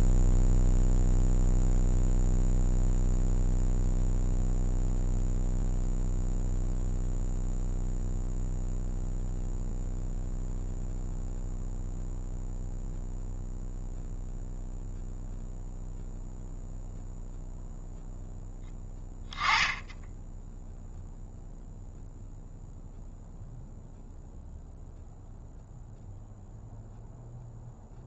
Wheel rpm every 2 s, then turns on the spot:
0, 0, 0, 0, 0, 0, 0, 0, 0, 10, 0, 0, 0, 0.
none